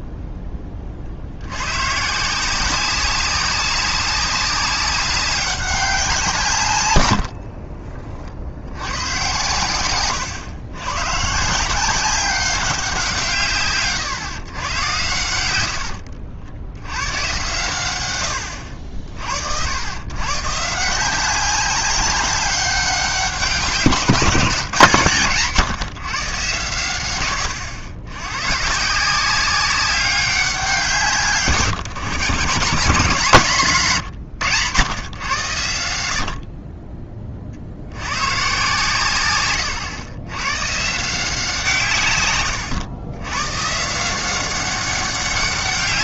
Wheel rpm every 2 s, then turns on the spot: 10, 170, 190, 160, 70, 120, 190, 120, 80, 80, 140, 190, 160, 120, 130, 180, 140, 120, 50, 110, 120, 120, 190.
none